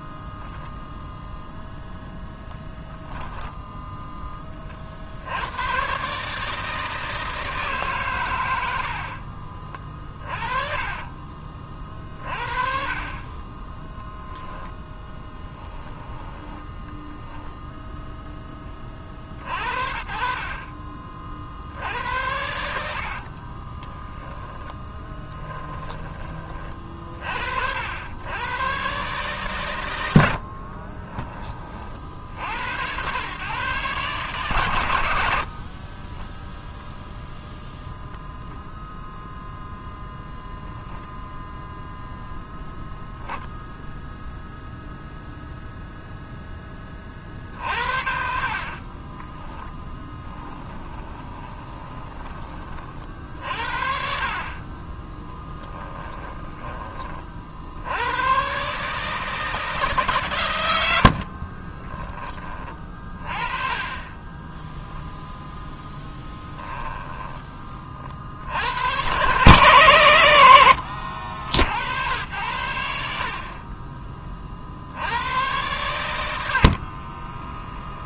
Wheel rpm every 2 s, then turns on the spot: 0, 10, 40, 160, 90, 40, 40, 10, 10, 20, 40, 80, 10, 30, 120, 50, 80, 140, 0, 0, 0, 0, 0, 20, 40, 10, 40, 30, 20, 140, 100, 30, 0, 10, 90, 90, 80, 50, 80.
10-14 16-18 22-26 30-32 48-52 66-68